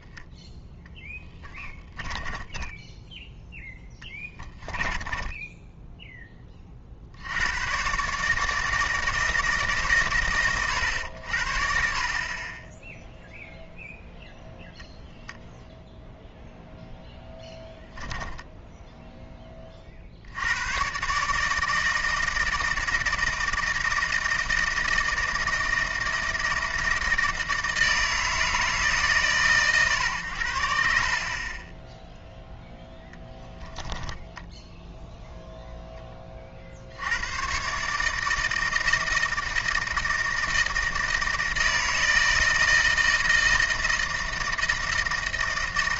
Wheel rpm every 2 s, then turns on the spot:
0, 10, 10, 30, 160, 90, 20, 0, 0, 10, 100, 160, 160, 160, 150, 80, 10, 10, 50, 160, 160, 160, 160.
2-6 18-20